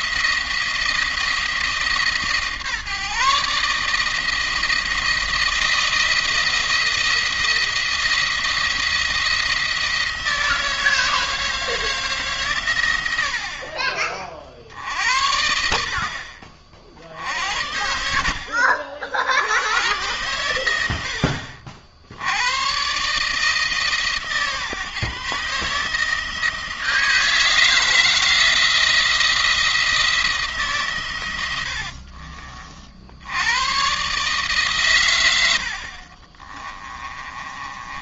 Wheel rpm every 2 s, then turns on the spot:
170, 150, 160, 170, 170, 160, 120, 60, 50, 60, 90, 120, 150, 160, 160, 150, 50, 130, 30.
36-38